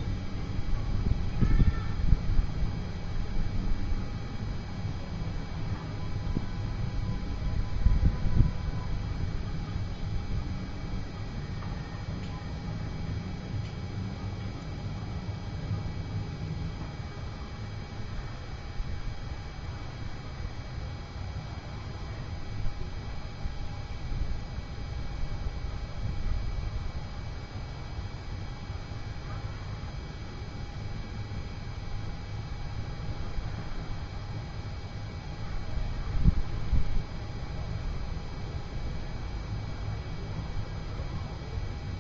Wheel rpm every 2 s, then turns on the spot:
0, 0, 0, 0, 0, 0, 0, 0, 0, 0, 0, 0, 0, 0, 0, 0, 0, 0, 0, 0, 0.
none